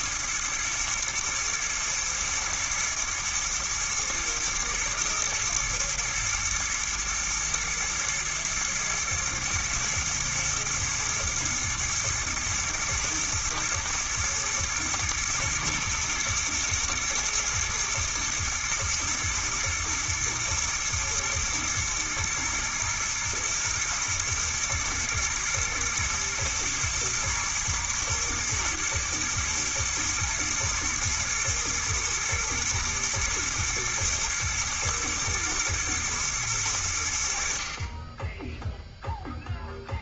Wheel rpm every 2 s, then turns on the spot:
110, 120, 110, 120, 110, 120, 120, 120, 120, 120, 110, 110, 110, 110, 110, 110, 110, 110, 80, 0.
none